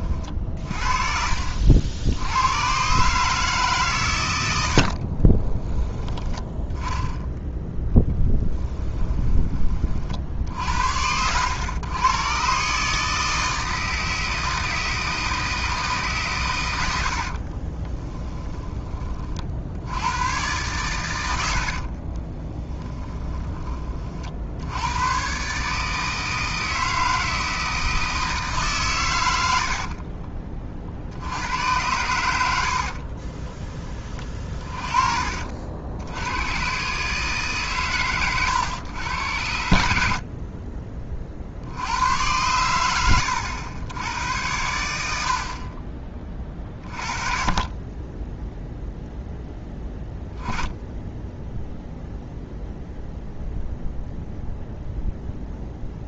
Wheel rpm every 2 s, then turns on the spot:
40, 110, 70, 10, 10, 70, 140, 160, 110, 20, 120, 20, 100, 160, 140, 40, 70, 30, 130, 110, 30, 100, 90, 30, 0, 10, 0, 0.
0-2 8-10 22-24 32-36